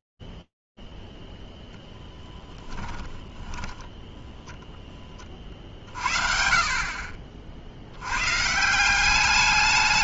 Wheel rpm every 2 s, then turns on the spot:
10, 20, 30, 190, 180.
0-2